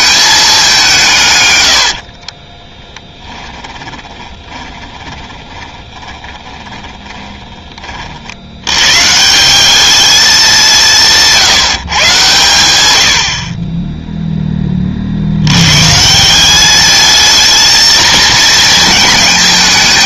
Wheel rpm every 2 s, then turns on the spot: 190, 20, 20, 20, 110, 190, 100, 30, 210, 220.
2-8